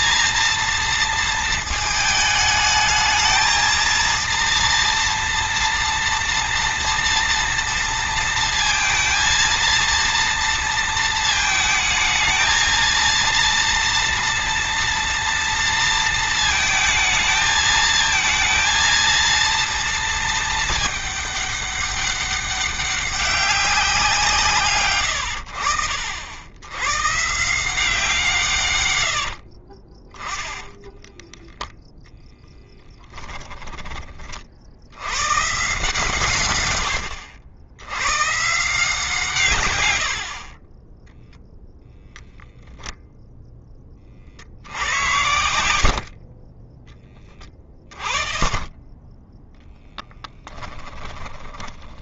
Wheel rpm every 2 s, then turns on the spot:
230, 220, 230, 230, 230, 230, 220, 230, 220, 220, 220, 200, 150, 100, 130, 10, 10, 60, 130, 140, 40, 0, 70, 30, 30, 10.
30-32